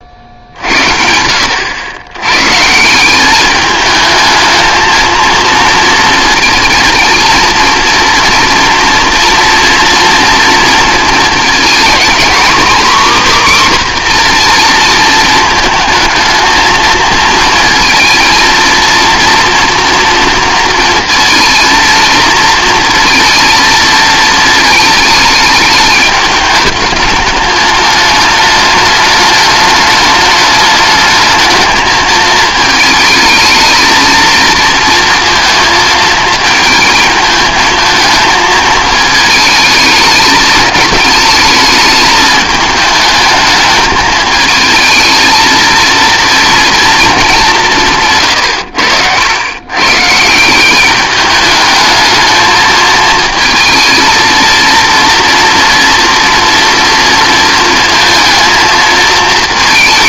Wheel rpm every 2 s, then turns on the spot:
70, 150, 220, 230, 230, 230, 260, 230, 230, 230, 230, 230, 220, 210, 210, 220, 220, 230, 220, 220, 220, 210, 220, 230, 100, 180, 220, 230, 230, 220.
none